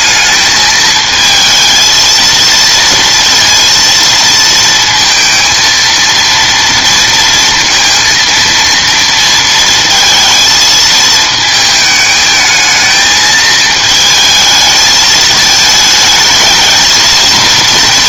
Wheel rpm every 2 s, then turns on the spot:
220, 230, 230, 230, 230, 220, 220, 220, 220.
none